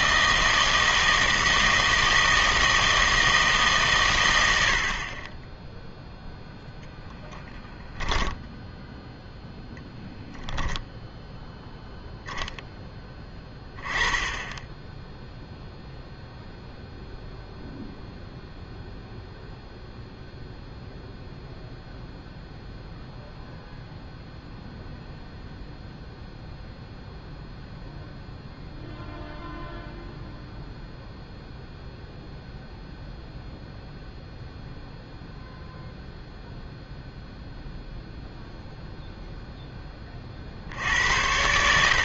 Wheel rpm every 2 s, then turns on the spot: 160, 160, 80, 10, 10, 0, 0, 10, 0, 0, 0, 0, 0, 0, 0, 0, 0, 0, 0, 0, 70.
none